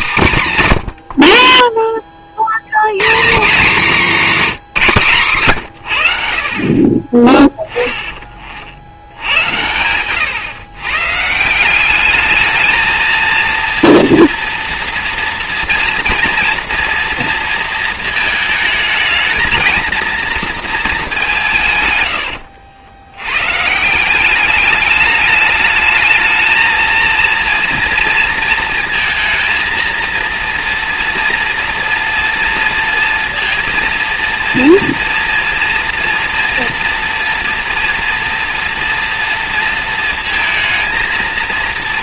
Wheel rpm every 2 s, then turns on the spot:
80, 150, 160, 30, 90, 140, 220, 230, 230, 220, 200, 90, 200, 230, 230, 230, 230, 230, 240, 240, 230.
0-2